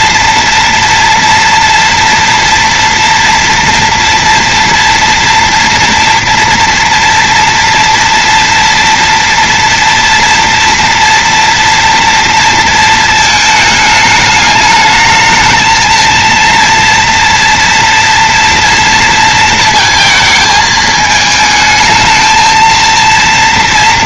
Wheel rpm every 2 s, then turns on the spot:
230, 230, 230, 230, 230, 240, 230, 210, 230, 230, 220, 230.
none